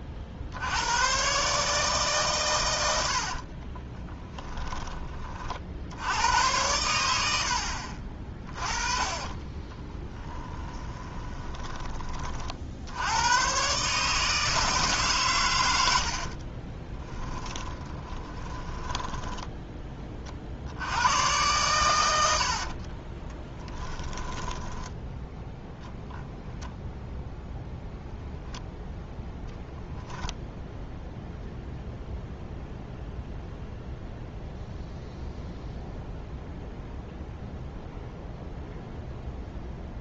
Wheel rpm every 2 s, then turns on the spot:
90, 100, 10, 90, 30, 20, 70, 150, 30, 10, 80, 40, 10, 0, 0, 0, 0, 0, 0, 0.
8-12 16-20 22-26